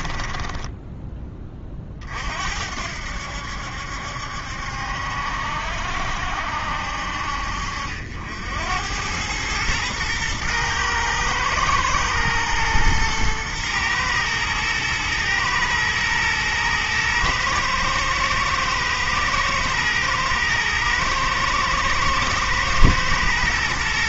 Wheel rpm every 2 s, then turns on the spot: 20, 70, 70, 60, 90, 110, 110, 110, 110, 110, 110, 110.
0-2